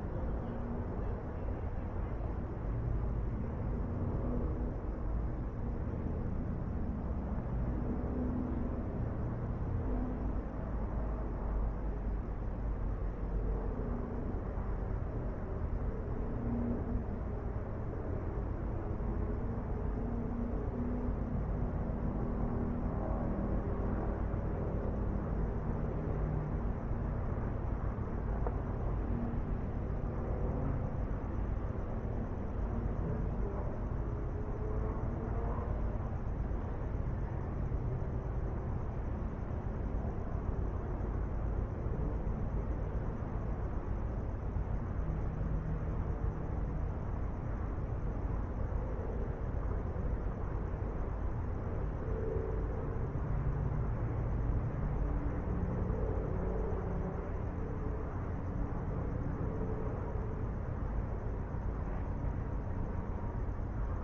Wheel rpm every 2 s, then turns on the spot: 0, 0, 0, 0, 0, 0, 0, 0, 0, 0, 0, 0, 0, 0, 0, 0, 0, 0, 0, 0, 0, 0, 0, 0, 0, 0, 0, 0, 0, 0, 0, 0.
none